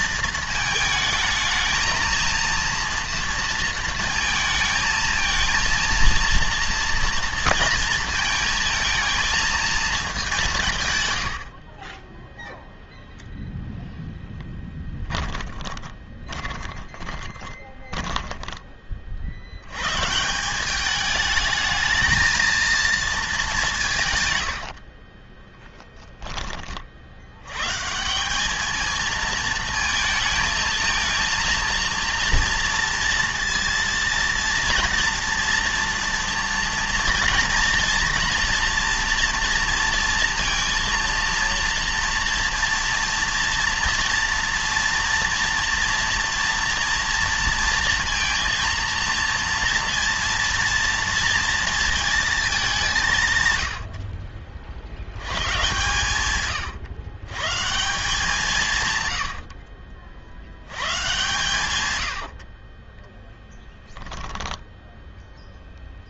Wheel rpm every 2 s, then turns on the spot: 220, 230, 220, 230, 230, 160, 0, 10, 20, 20, 200, 230, 60, 40, 220, 220, 230, 240, 240, 230, 230, 230, 230, 230, 230, 230, 200, 60, 120, 150, 110, 30, 10.
14-18 24-26 62-66